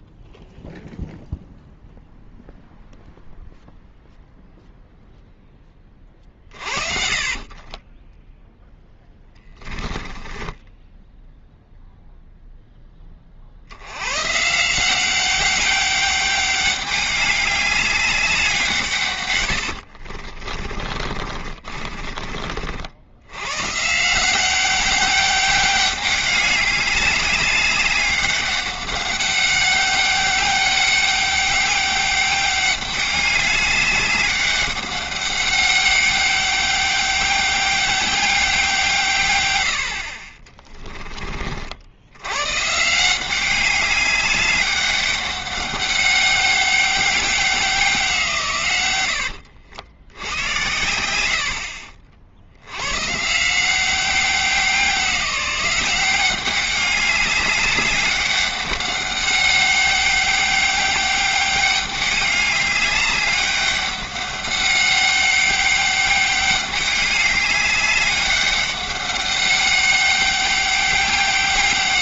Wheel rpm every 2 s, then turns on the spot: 0, 0, 0, 40, 10, 10, 0, 150, 200, 170, 30, 50, 190, 200, 200, 200, 200, 200, 200, 180, 20, 130, 200, 200, 120, 90, 100, 190, 200, 200, 190, 200, 200, 200, 200, 200.
6-8 10-12 20-22 40-42